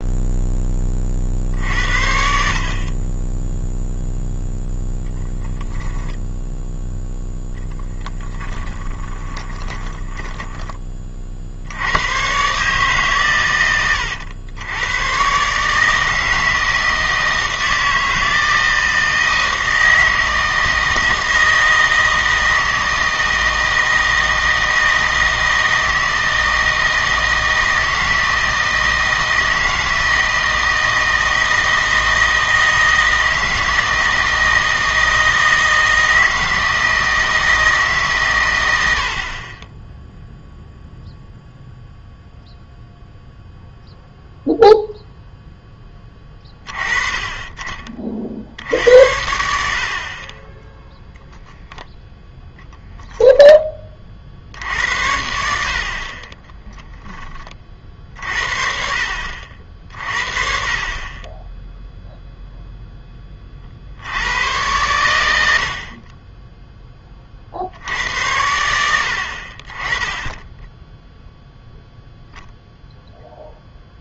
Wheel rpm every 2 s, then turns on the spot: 10, 50, 20, 0, 10, 30, 140, 100, 160, 160, 160, 160, 160, 160, 160, 160, 160, 160, 160, 100, 0, 0, 0, 20, 70, 10, 10, 70, 10, 50, 40, 0, 110, 10, 80, 10, 0.
8-10 56-58